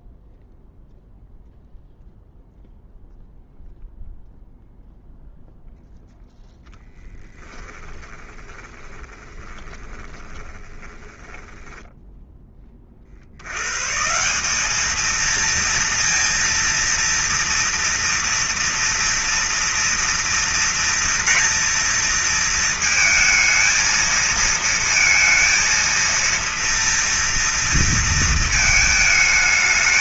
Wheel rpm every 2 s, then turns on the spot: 0, 0, 0, 10, 20, 30, 40, 220, 230, 230, 230, 230, 230, 230, 220.
6-12